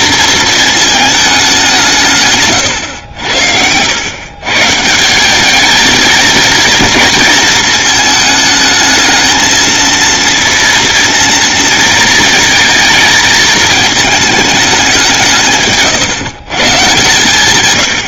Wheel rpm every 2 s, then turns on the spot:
220, 90, 170, 240, 220, 230, 220, 190, 150.
none